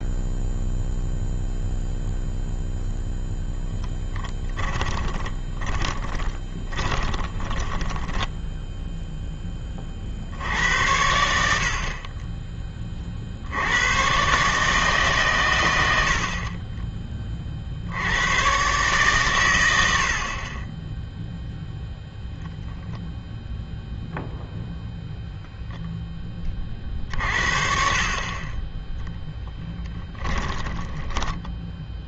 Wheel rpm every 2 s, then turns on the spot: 0, 0, 20, 20, 0, 70, 20, 150, 30, 130, 10, 0, 0, 30, 10, 10.
4-8 30-32